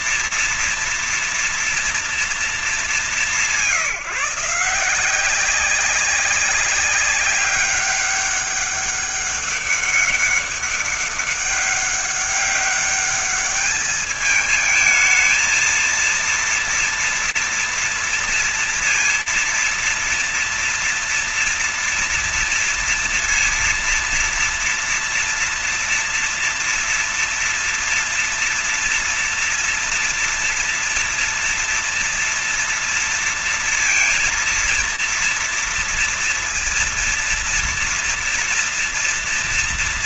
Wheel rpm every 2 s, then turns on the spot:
230, 240, 180, 190, 200, 200, 200, 200, 220, 230, 230, 230, 230, 230, 230, 230, 230, 230, 230, 230.
none